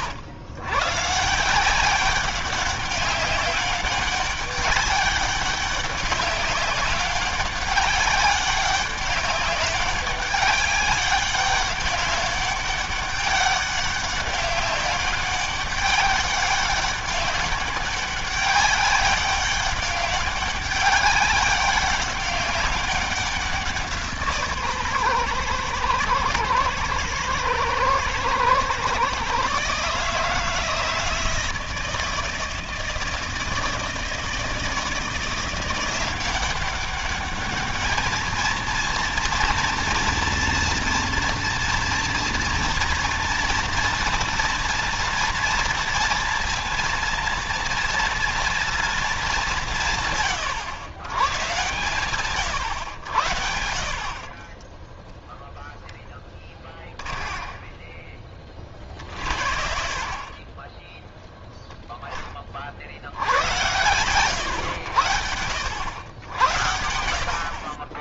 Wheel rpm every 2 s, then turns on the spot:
130, 200, 200, 190, 200, 200, 200, 200, 200, 200, 200, 190, 140, 110, 120, 160, 160, 170, 200, 230, 230, 230, 240, 230, 230, 120, 100, 20, 30, 40, 10, 50, 120, 80.
54-62